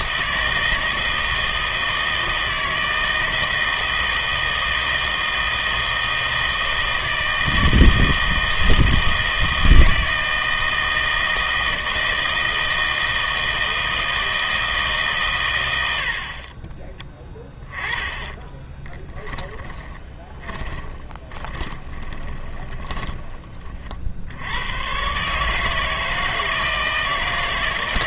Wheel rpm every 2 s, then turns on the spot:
160, 160, 160, 160, 160, 170, 160, 160, 30, 20, 30, 20, 100, 160.
18-24